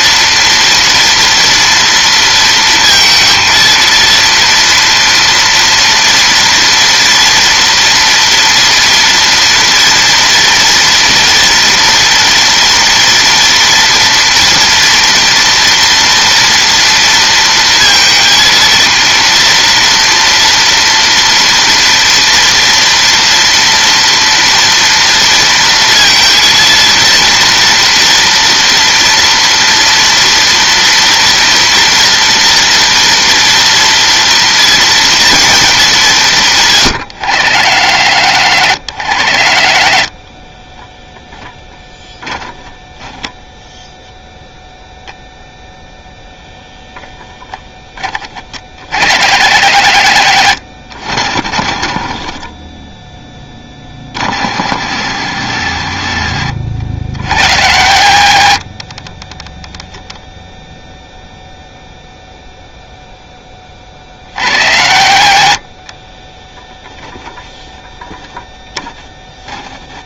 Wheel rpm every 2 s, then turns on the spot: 230, 230, 230, 240, 230, 230, 230, 230, 230, 230, 230, 230, 230, 230, 230, 230, 230, 230, 150, 80, 20, 10, 0, 0, 40, 60, 10, 40, 40, 40, 0, 0, 50, 10, 10.
none